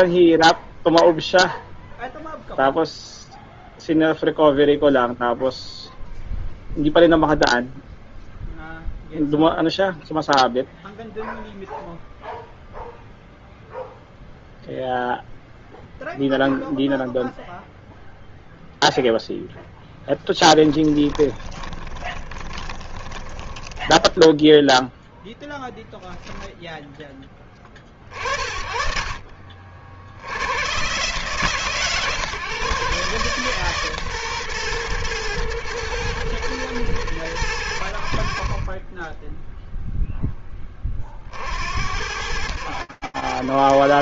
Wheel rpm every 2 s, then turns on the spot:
0, 0, 0, 0, 0, 0, 0, 0, 0, 0, 10, 10, 0, 10, 40, 130, 140, 120, 110, 20, 30, 90.
20-24